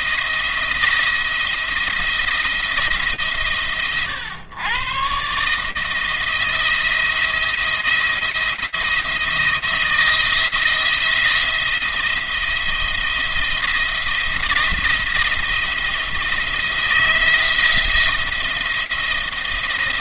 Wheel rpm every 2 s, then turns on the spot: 170, 160, 120, 170, 170, 170, 170, 170, 170, 170.
none